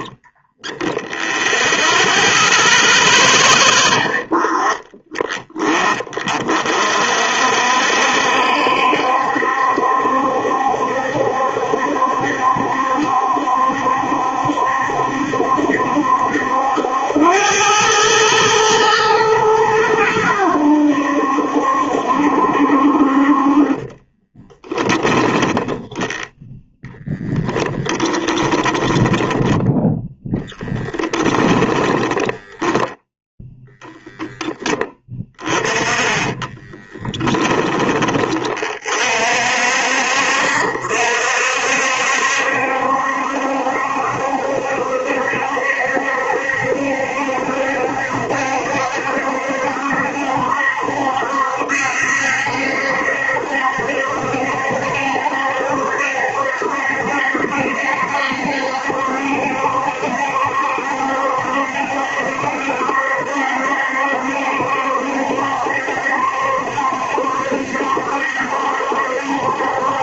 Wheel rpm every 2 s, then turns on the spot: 0, 0, 20, 50, 70, 70, 70, 70, 80, 110, 80, 60, 20, 0, 10, 10, 10, 20, 10, 40, 60, 70, 70, 70, 70, 70, 70, 70, 70, 70, 70, 70, 70, 70, 70.
24-26 28-32 36-38